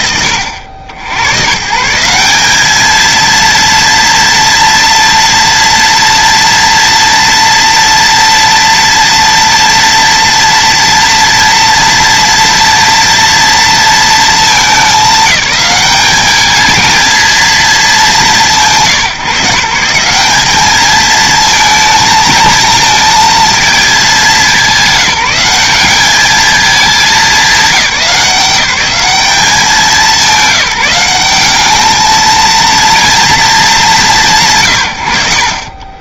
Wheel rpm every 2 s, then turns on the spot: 90, 220, 230, 230, 230, 230, 230, 200, 230, 150, 220, 220, 190, 210, 190, 190, 230, 100.
none